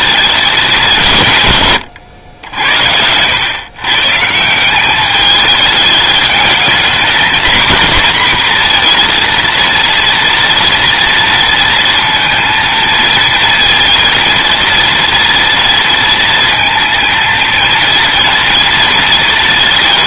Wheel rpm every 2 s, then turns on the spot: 190, 90, 180, 220, 230, 230, 230, 230, 230, 230.
none